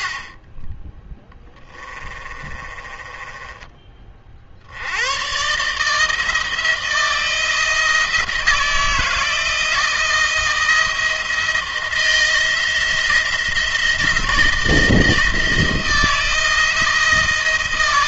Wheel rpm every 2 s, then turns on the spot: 20, 20, 70, 160, 160, 170, 160, 160, 170.
2-4